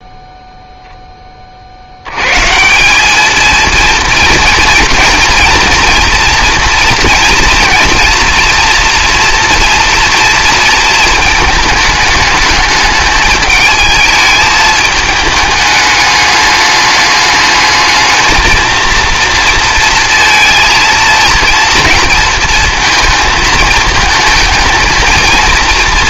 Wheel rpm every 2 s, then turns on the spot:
10, 200, 230, 230, 240, 220, 210, 210, 210, 230, 230, 220, 230.
none